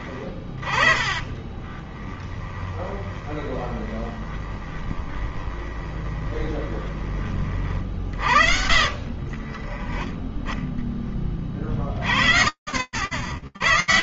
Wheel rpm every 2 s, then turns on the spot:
20, 20, 20, 20, 60, 10, 70.
0-10